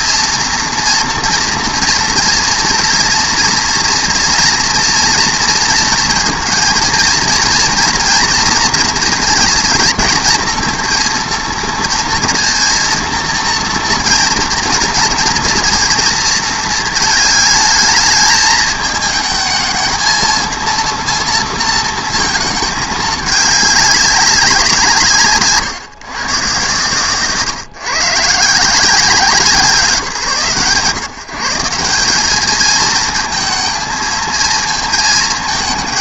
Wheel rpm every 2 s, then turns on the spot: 240, 230, 230, 230, 230, 220, 230, 230, 230, 220, 230, 220, 190, 120, 160, 140, 210, 220.
none